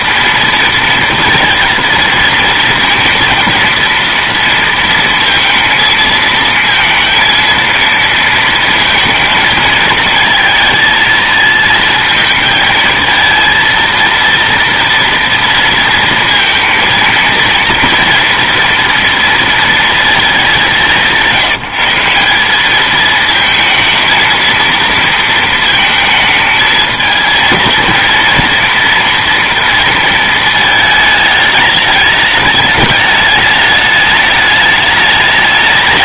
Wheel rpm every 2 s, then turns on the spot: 230, 230, 230, 230, 230, 220, 220, 230, 230, 230, 190, 220, 230, 220, 230, 220, 210, 210.
none